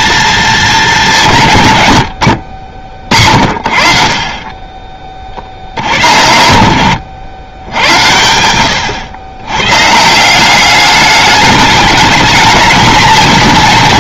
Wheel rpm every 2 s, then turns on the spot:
210, 60, 20, 90, 100, 200, 230.
none